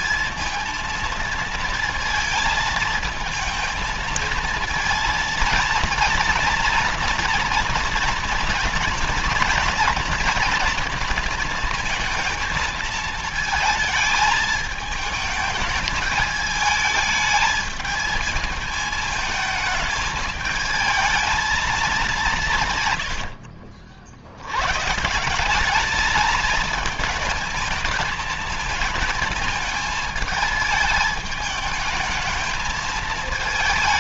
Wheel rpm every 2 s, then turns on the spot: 230, 220, 230, 230, 230, 230, 230, 220, 220, 220, 220, 150, 110, 220, 220, 220, 220.
22-24